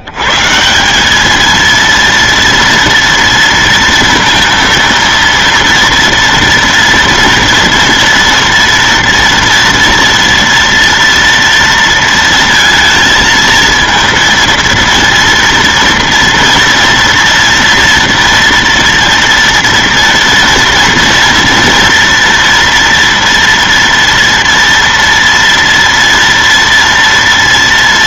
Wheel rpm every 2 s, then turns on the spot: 120, 230, 230, 240, 230, 240, 230, 230, 230, 230, 230, 230, 230, 230.
none